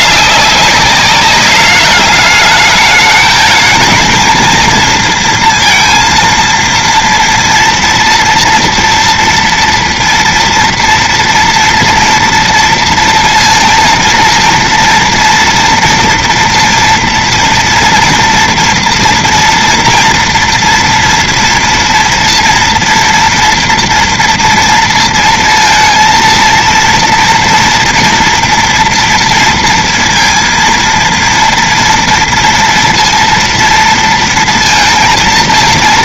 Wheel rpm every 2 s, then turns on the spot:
210, 210, 230, 230, 230, 230, 240, 230, 230, 240, 230, 230, 240, 230, 230, 230, 230, 230.
none